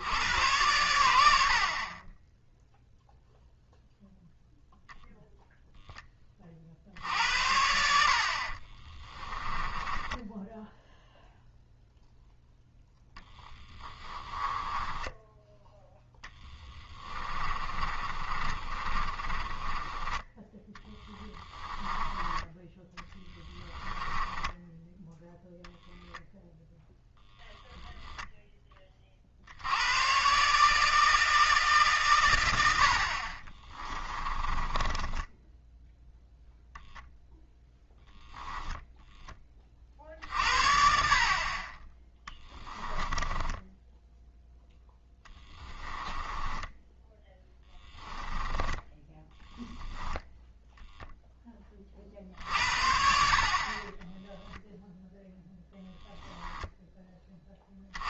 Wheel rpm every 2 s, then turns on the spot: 100, 0, 0, 50, 30, 0, 10, 10, 20, 30, 20, 20, 10, 0, 20, 150, 80, 20, 0, 10, 60, 10, 10, 10, 20, 10, 50, 0, 10.
8-10 14-22 24-26 34-36 42-48